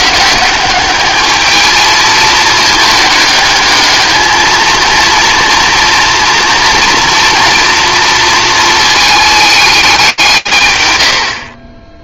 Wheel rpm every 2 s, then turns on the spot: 190, 210, 230, 230, 220, 130.
none